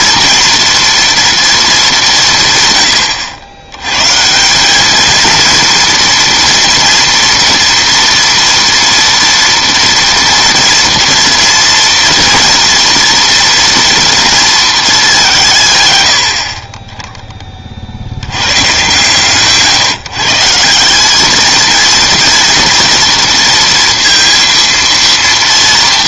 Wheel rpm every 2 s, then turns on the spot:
230, 130, 190, 230, 230, 230, 230, 220, 40, 120, 170, 230, 230.
none